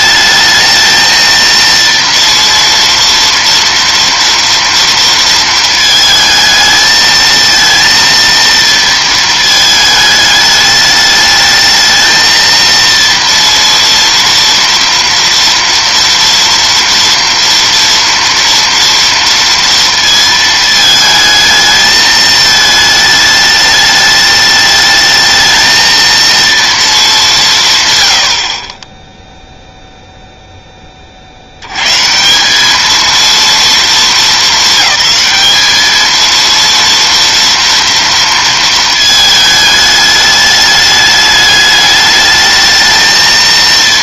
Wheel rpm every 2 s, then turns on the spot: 220, 230, 230, 220, 230, 210, 230, 230, 230, 230, 220, 220, 210, 220, 20, 20, 200, 200, 230, 220, 210, 220.
none